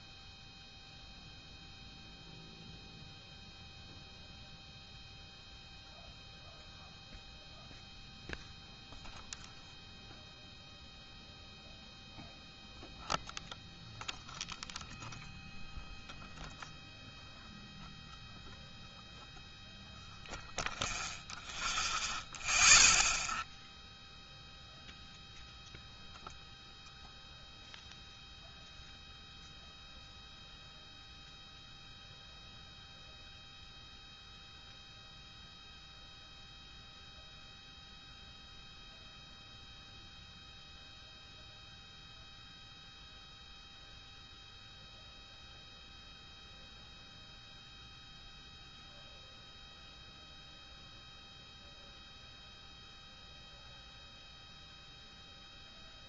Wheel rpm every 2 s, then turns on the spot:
0, 0, 0, 0, 0, 0, 0, 0, 0, 0, 0, 0, 0, 0, 0, 0, 0, 0, 0, 0, 0, 0, 0, 0, 0, 0, 0, 0.
none